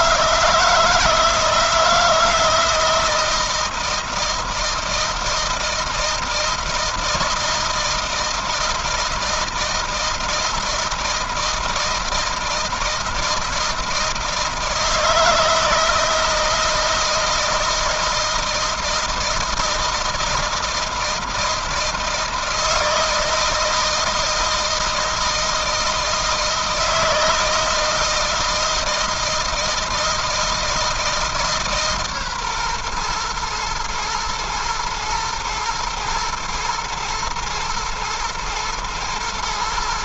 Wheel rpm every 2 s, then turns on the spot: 160, 160, 160, 160, 160, 160, 160, 160, 160, 160, 160, 160, 160, 160, 160, 160, 120, 120, 120, 110.
none